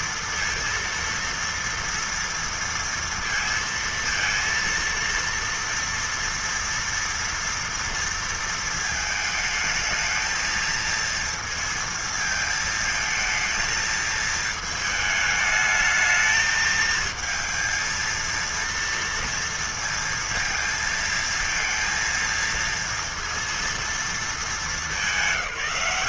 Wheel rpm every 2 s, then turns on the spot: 230, 230, 230, 230, 220, 220, 220, 220, 220, 230, 230, 230, 200.
none